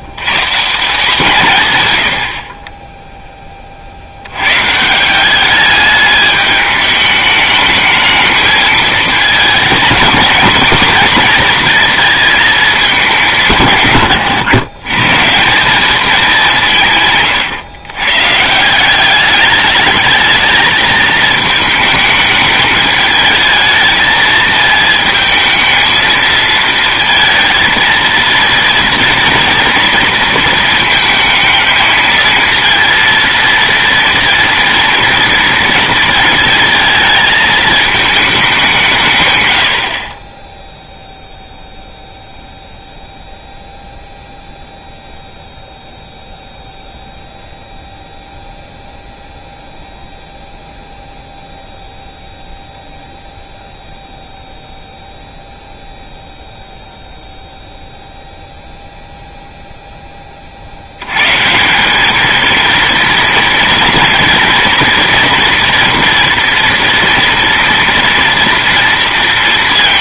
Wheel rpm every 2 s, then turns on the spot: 160, 30, 130, 210, 220, 230, 220, 120, 170, 160, 220, 210, 220, 230, 230, 230, 230, 240, 230, 190, 10, 0, 0, 0, 0, 0, 0, 0, 0, 0, 60, 220, 230, 230, 230.
none